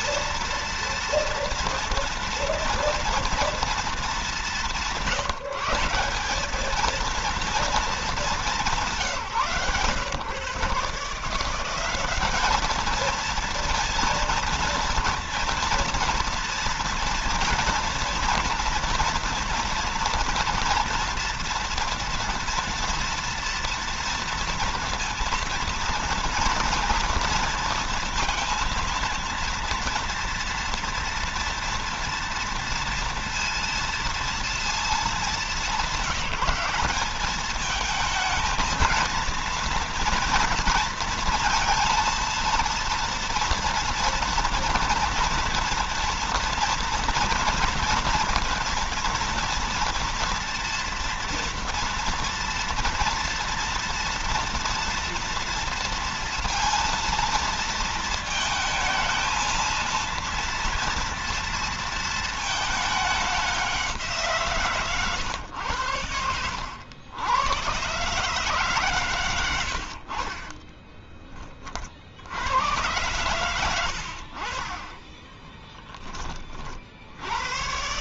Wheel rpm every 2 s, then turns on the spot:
230, 230, 170, 220, 170, 160, 220, 230, 230, 230, 230, 230, 230, 230, 230, 230, 230, 220, 210, 230, 230, 230, 240, 230, 230, 240, 230, 230, 230, 220, 230, 210, 130, 90, 120, 20, 100, 20, 70.
70-72 74-76